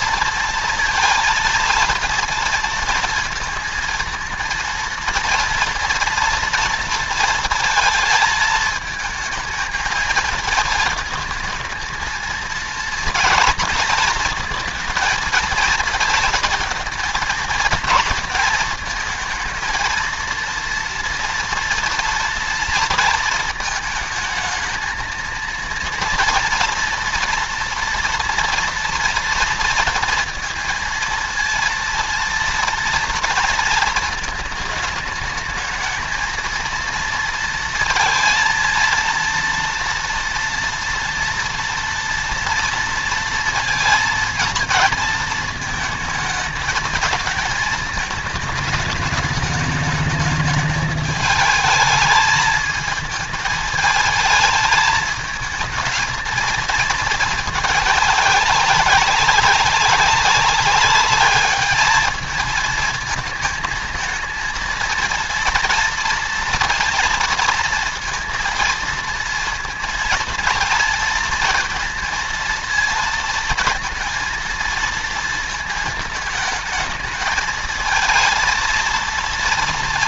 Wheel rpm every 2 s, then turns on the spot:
230, 230, 230, 230, 220, 220, 230, 230, 220, 220, 230, 230, 230, 230, 230, 230, 230, 220, 230, 230, 230, 230, 230, 220, 220, 210, 220, 220, 220, 200, 200, 220, 230, 230, 230, 230, 230, 230, 220, 230.
none